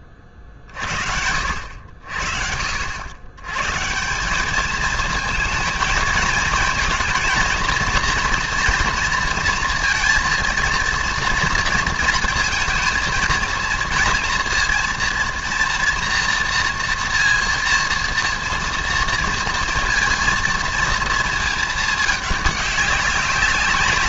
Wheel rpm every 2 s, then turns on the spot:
50, 70, 210, 220, 230, 230, 230, 230, 230, 230, 230, 200.
none